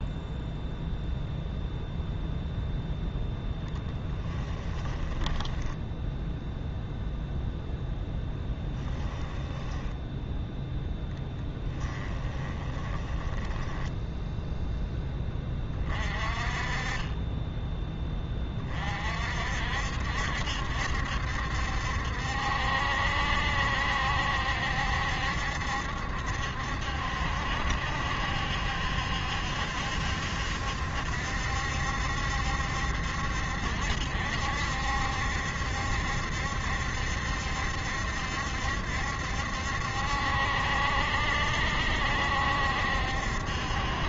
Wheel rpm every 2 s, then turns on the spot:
0, 0, 10, 0, 10, 10, 20, 10, 20, 40, 70, 70, 70, 70, 70, 70, 70, 70, 70, 70, 70, 70.
4-6 8-10 12-14